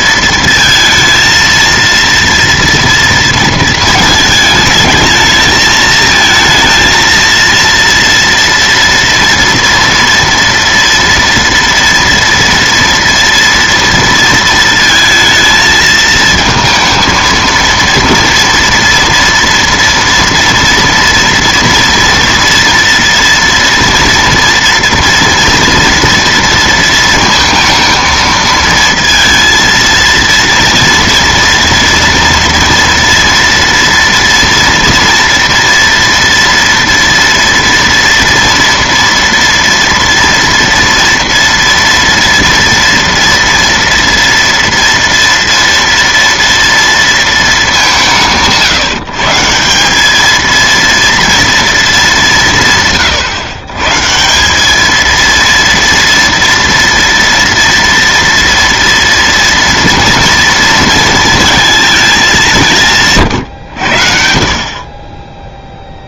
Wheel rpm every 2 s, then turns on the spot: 230, 230, 220, 220, 230, 230, 230, 230, 230, 230, 230, 230, 230, 230, 230, 230, 230, 230, 230, 230, 230, 230, 230, 230, 160, 230, 150, 200, 230, 230, 230, 160, 40.
none